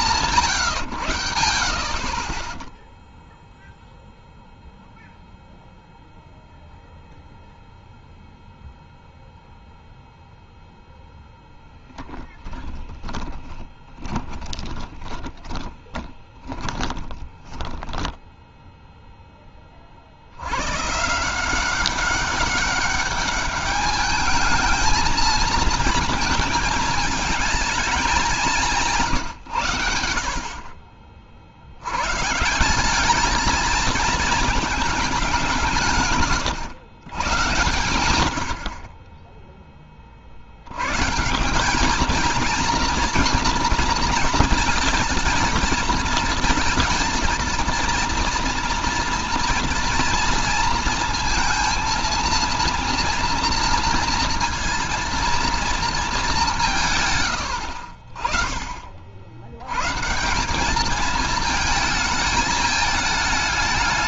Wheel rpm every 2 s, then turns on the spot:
20, 0, 0, 0, 0, 10, 20, 20, 10, 40, 190, 210, 220, 210, 90, 90, 220, 150, 100, 10, 190, 240, 220, 230, 230, 230, 230, 230, 80, 70, 220, 210.
10-18 34-36